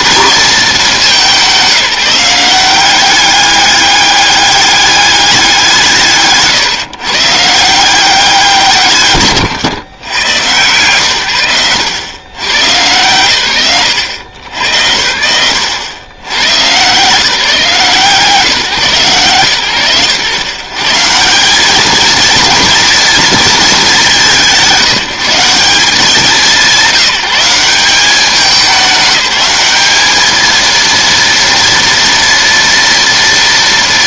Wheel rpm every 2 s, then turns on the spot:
210, 190, 200, 130, 160, 120, 140, 90, 130, 140, 130, 230, 180, 190, 200, 230, 230.
none